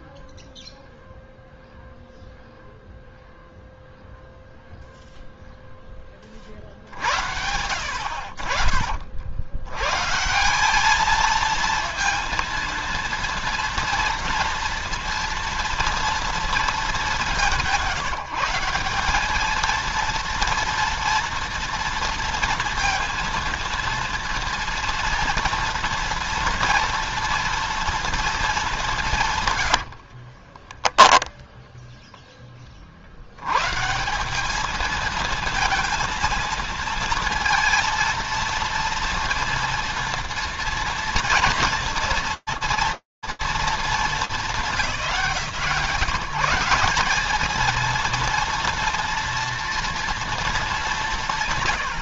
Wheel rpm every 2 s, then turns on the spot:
0, 0, 0, 40, 70, 150, 230, 230, 230, 170, 230, 230, 230, 240, 230, 40, 10, 170, 220, 230, 230, 230, 180, 190, 230, 200.
30-32